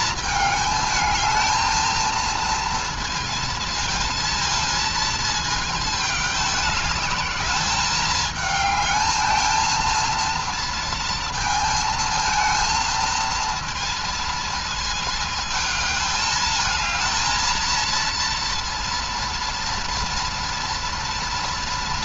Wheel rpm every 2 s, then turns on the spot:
220, 230, 220, 210, 210, 230, 230, 220, 220, 230, 230.
none